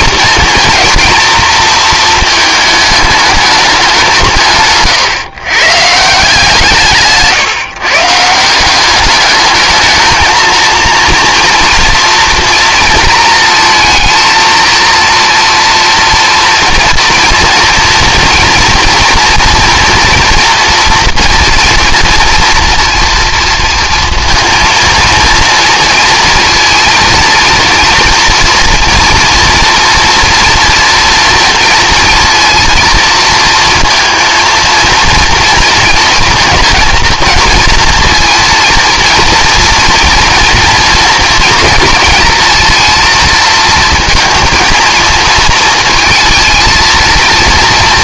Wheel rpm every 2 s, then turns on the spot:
230, 220, 130, 160, 180, 230, 230, 230, 230, 230, 230, 230, 230, 230, 230, 230, 230, 230, 230, 230, 240, 230, 230, 230.
4-6